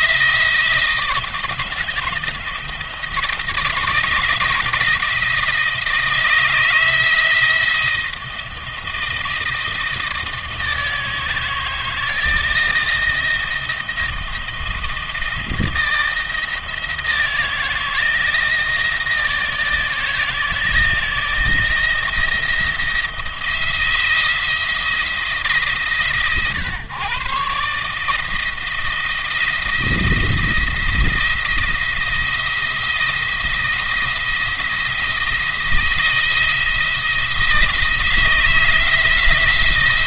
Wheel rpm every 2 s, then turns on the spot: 160, 160, 160, 160, 160, 160, 160, 160, 160, 160, 160, 170, 160, 130, 170, 170, 170, 170, 160, 160.
none